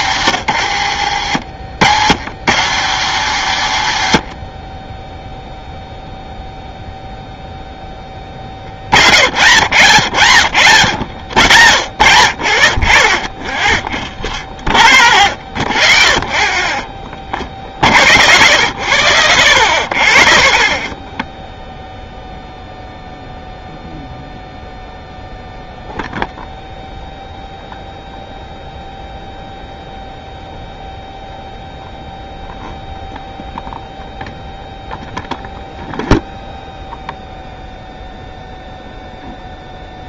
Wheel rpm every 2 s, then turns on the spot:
110, 150, 50, 0, 0, 0, 0, 0, 0, 0, 0, 0, 0, 0, 0, 0, 0, 0, 0, 0.
0-2